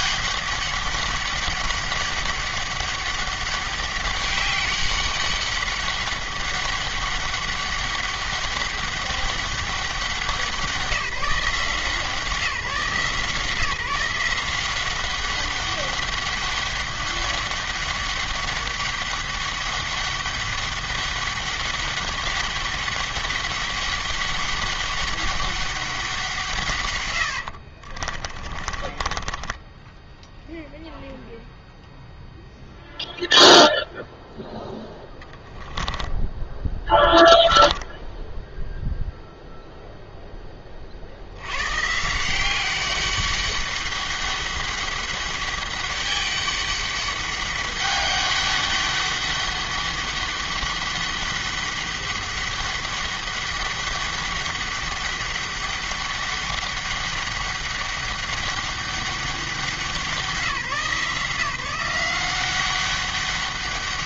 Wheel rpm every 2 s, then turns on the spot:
200, 200, 200, 200, 200, 180, 160, 180, 200, 200, 200, 200, 200, 120, 30, 0, 0, 0, 10, 0, 40, 190, 200, 200, 200, 200, 200, 200, 200, 200, 160, 190.
28-30 36-38